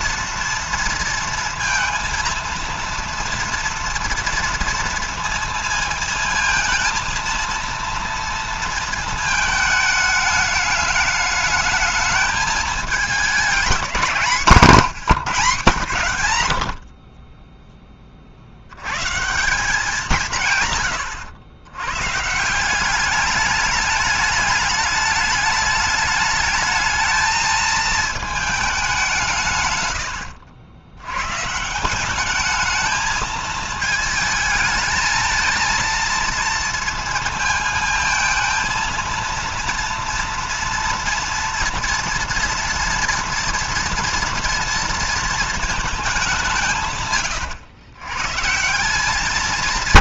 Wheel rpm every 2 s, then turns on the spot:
230, 230, 230, 230, 220, 210, 220, 160, 20, 140, 110, 200, 210, 220, 180, 120, 220, 220, 230, 230, 230, 230, 230, 140, 180.
none